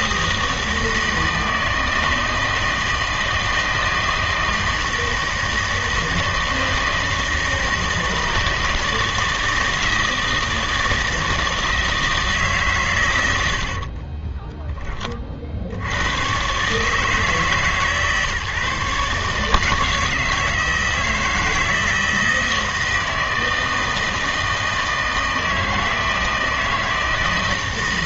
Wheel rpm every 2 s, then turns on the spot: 160, 160, 160, 160, 160, 160, 150, 20, 110, 140, 160, 160, 160, 160.
14-16